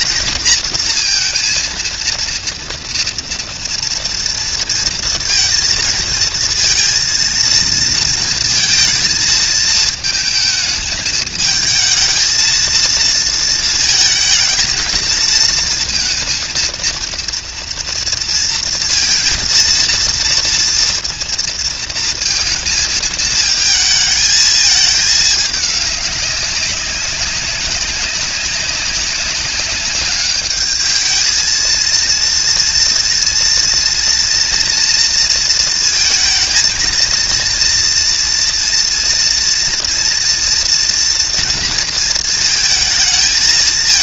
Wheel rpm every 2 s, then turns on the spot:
230, 230, 230, 230, 230, 220, 220, 220, 230, 230, 230, 230, 220, 200, 200, 210, 230, 230, 230, 240, 230, 220.
none